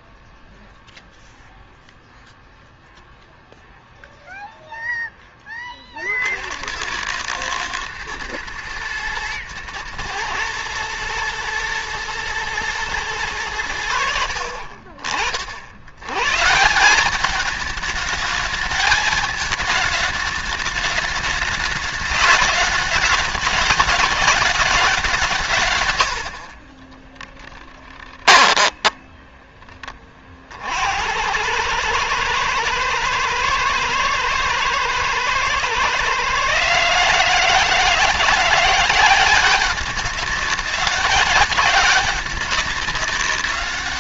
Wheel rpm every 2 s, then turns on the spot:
0, 0, 0, 70, 110, 110, 110, 60, 150, 210, 210, 210, 200, 50, 10, 50, 110, 110, 140, 170, 200, 200.
26-30